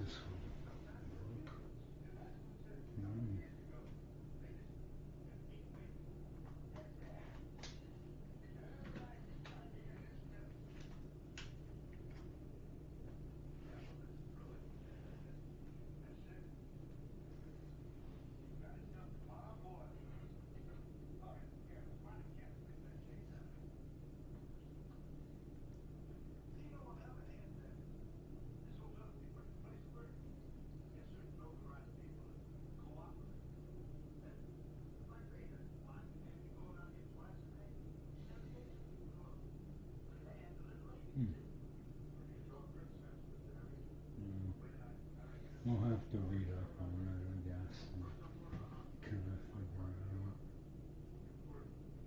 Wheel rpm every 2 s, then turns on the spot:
0, 0, 0, 0, 0, 0, 0, 0, 0, 0, 0, 0, 0, 0, 0, 0, 0, 0, 0, 0, 0, 0, 0, 0, 0, 0.
none